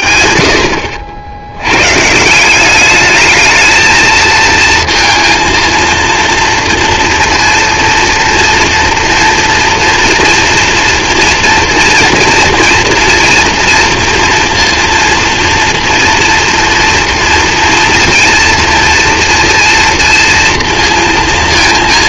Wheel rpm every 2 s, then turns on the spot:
50, 120, 220, 230, 230, 230, 230, 230, 230, 230, 230.
none